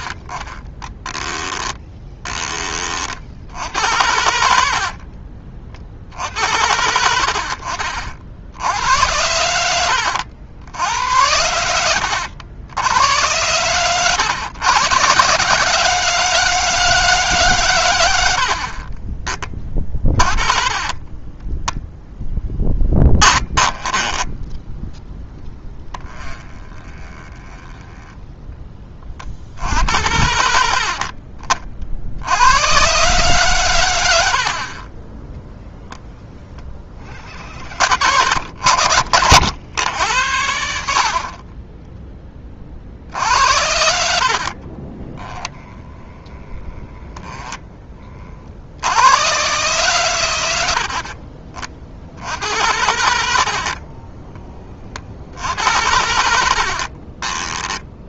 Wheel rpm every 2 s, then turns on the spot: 10, 30, 60, 70, 90, 80, 80, 110, 160, 50, 30, 10, 10, 20, 20, 50, 120, 30, 40, 70, 60, 40, 30, 10, 70, 80, 80, 40, 60.
0-2 4-6 20-24 26-28 44-46 56-58